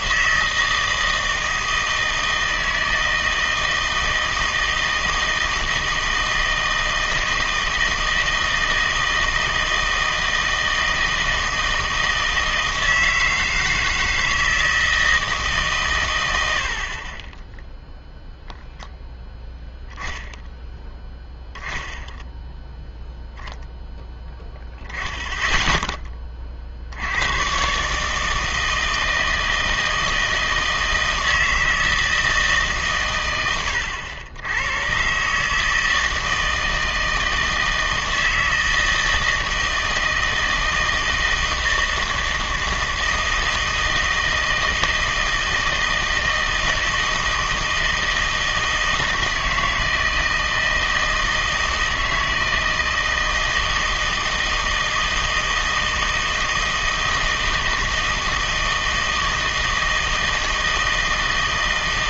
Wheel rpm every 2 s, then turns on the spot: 160, 160, 160, 160, 160, 160, 160, 160, 80, 0, 0, 0, 0, 50, 160, 160, 140, 100, 160, 160, 160, 160, 160, 160, 160, 160, 160, 160, 160, 160, 160.
none